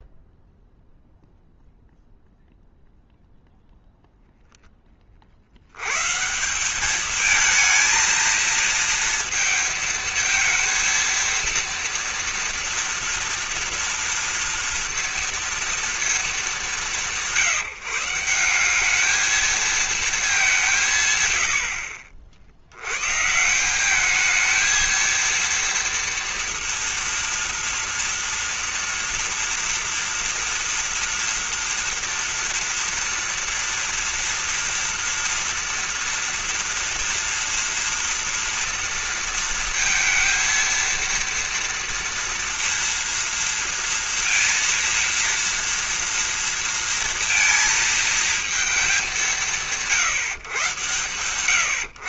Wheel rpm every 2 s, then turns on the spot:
0, 0, 10, 180, 230, 220, 230, 230, 180, 190, 180, 100, 230, 230, 230, 240, 230, 230, 240, 230, 230, 230, 230, 230, 210, 130.
none